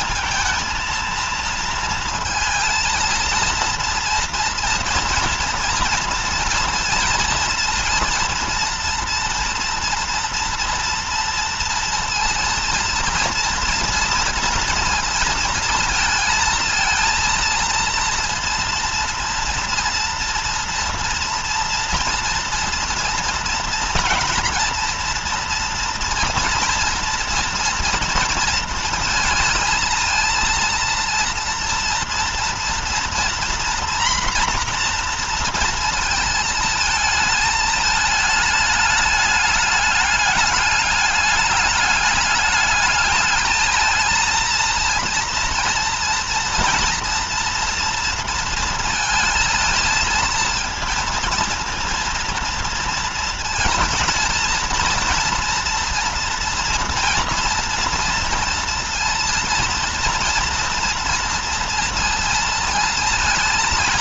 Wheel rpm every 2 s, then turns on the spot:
230, 230, 230, 230, 230, 230, 230, 230, 220, 230, 230, 230, 230, 240, 230, 230, 230, 240, 230, 210, 210, 210, 230, 230, 230, 230, 230, 230, 230, 230, 230, 230.
none